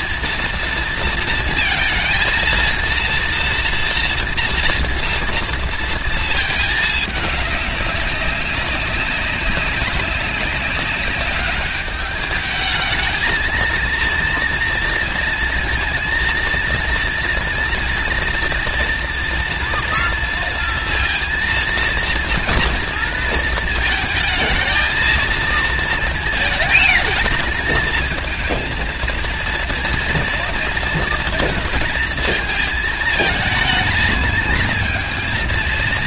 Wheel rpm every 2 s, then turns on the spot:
230, 230, 230, 220, 190, 200, 210, 230, 230, 230, 230, 230, 220, 230, 220, 230, 220, 230.
none